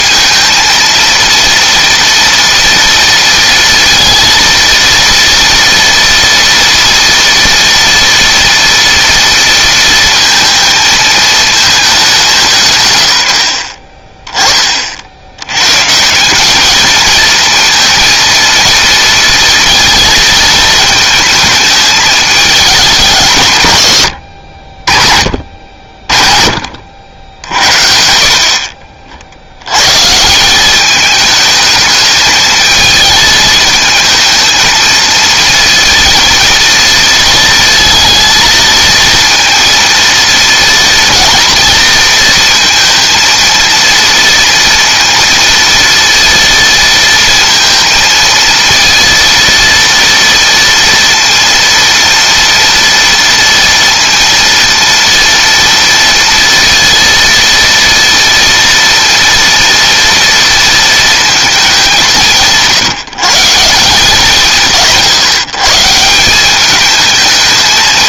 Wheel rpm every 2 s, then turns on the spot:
230, 230, 230, 230, 230, 230, 190, 20, 180, 230, 220, 210, 90, 50, 60, 160, 210, 220, 230, 230, 230, 230, 230, 230, 230, 230, 230, 230, 230, 230, 230, 160, 160, 180.
none